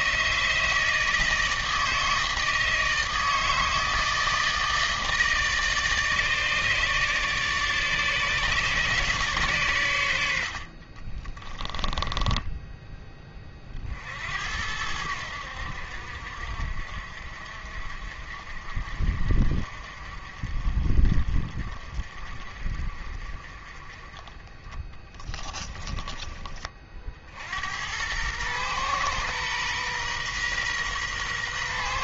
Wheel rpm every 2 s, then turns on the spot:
160, 160, 160, 150, 140, 70, 10, 80, 60, 50, 50, 40, 20, 30, 120, 130.
12-14